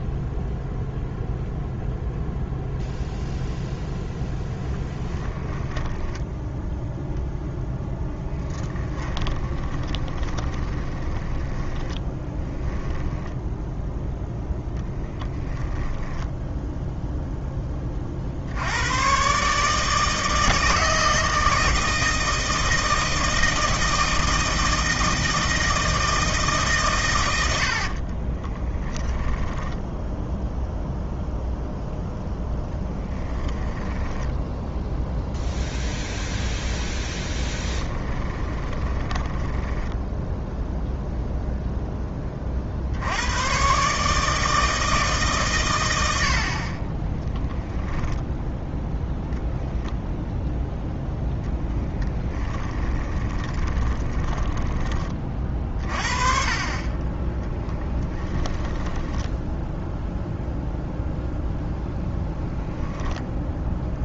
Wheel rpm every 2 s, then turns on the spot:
0, 0, 10, 0, 10, 10, 10, 10, 0, 100, 160, 160, 160, 130, 10, 0, 10, 10, 0, 20, 0, 50, 160, 30, 0, 10, 20, 20, 30, 10, 0, 0.
4-6 8-14 28-30 32-34 38-40 52-54 58-60